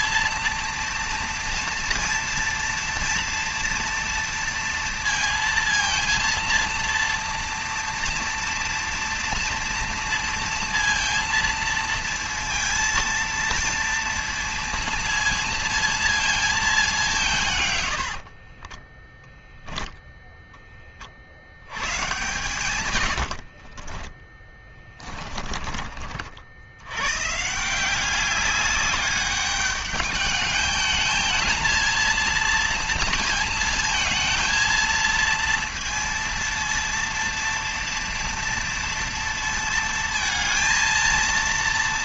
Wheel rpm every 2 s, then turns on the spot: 230, 230, 230, 230, 230, 230, 230, 230, 220, 80, 10, 130, 20, 50, 190, 210, 230, 220, 230, 230, 230.
18-20 24-26